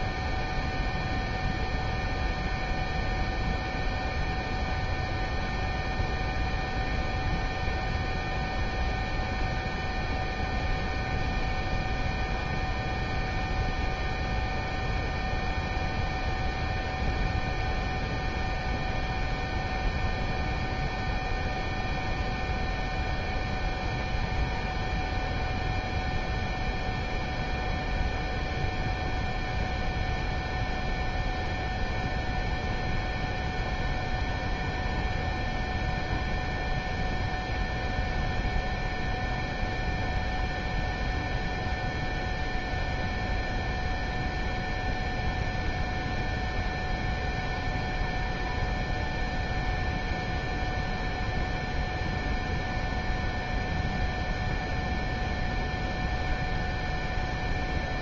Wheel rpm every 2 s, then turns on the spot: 0, 0, 0, 0, 0, 0, 0, 0, 0, 0, 0, 0, 0, 0, 0, 0, 0, 0, 0, 0, 0, 0, 0, 0, 0, 0, 0, 0, 0.
none